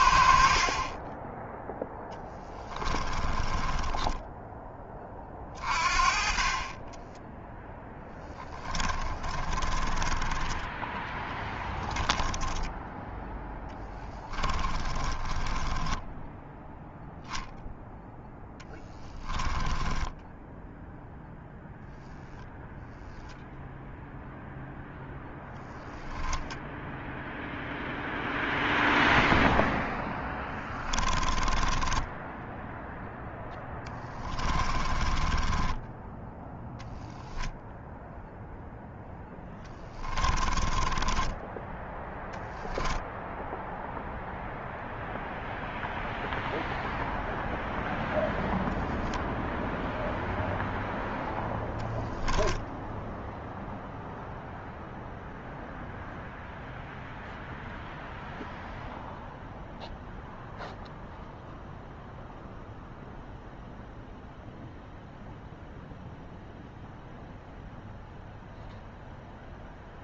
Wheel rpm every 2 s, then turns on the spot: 20, 10, 30, 10, 20, 10, 10, 20, 0, 10, 0, 0, 10, 10, 0, 20, 0, 20, 10, 0, 10, 0, 0, 0, 0, 0, 0, 0, 0, 0, 0, 0, 0, 0, 0.
2-4 6-12 14-16 18-20 24-26 30-32 34-36 40-42